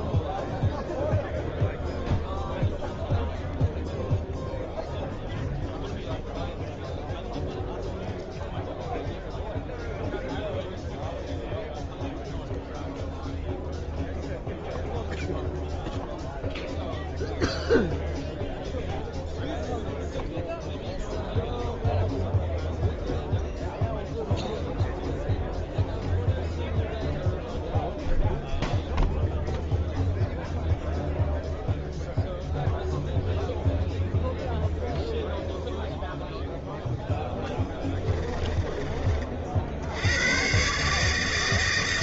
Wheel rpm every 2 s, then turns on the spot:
0, 0, 0, 0, 0, 0, 0, 0, 0, 0, 0, 0, 0, 0, 0, 0, 0, 0, 0, 20, 130.
38-40